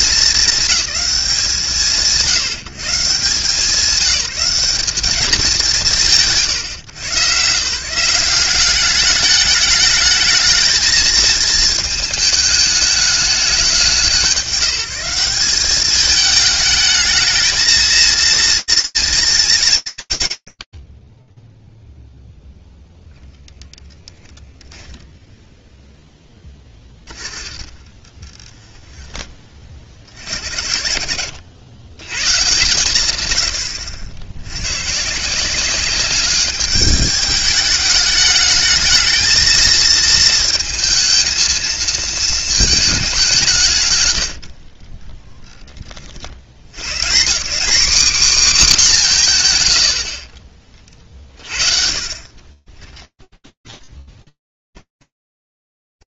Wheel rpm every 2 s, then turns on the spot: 180, 180, 170, 130, 210, 220, 190, 190, 220, 230, 90, 0, 0, 20, 20, 80, 100, 180, 210, 230, 230, 170, 30, 230, 100, 30, 10, 20.
26-28 50-56